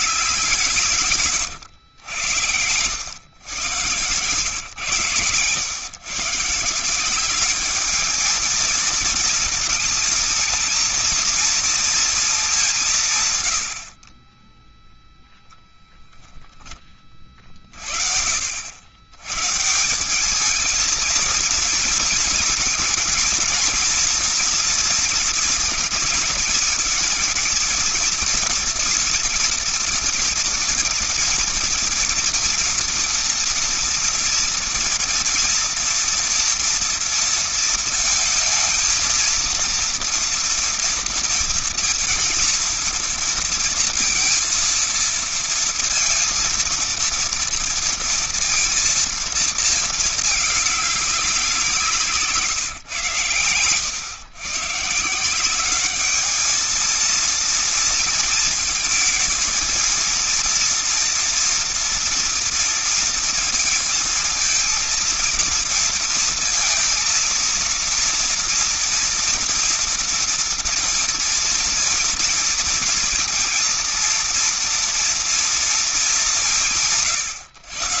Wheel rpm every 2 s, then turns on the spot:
180, 90, 120, 160, 220, 220, 210, 30, 10, 70, 210, 220, 230, 230, 230, 230, 230, 230, 230, 220, 230, 230, 230, 230, 230, 210, 150, 120, 220, 220, 230, 230, 230, 230, 230, 230, 230, 230, 190.
none